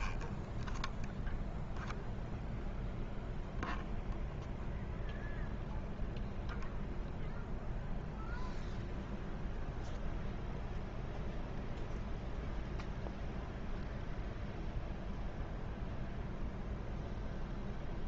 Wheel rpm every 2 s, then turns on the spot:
0, 0, 0, 0, 0, 0, 0, 0, 0.
none